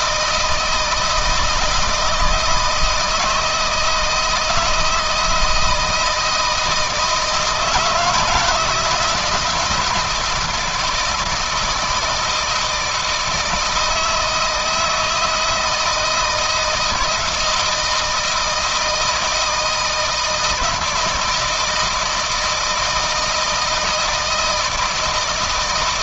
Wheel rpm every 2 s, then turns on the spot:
160, 160, 160, 160, 170, 160, 160, 160, 160, 160, 160, 160, 160.
none